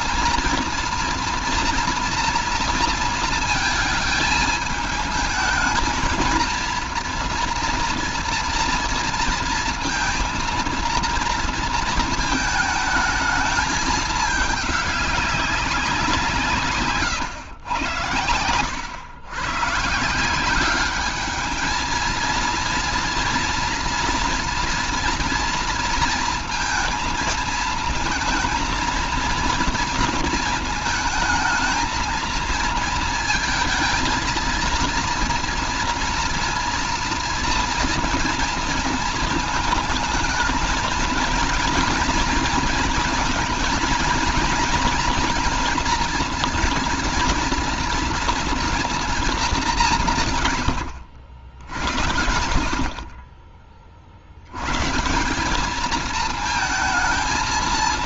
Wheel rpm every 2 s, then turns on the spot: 230, 230, 220, 230, 230, 230, 220, 220, 170, 100, 180, 230, 240, 230, 220, 220, 230, 230, 230, 230, 220, 230, 230, 230, 230, 150, 90, 90, 220.
none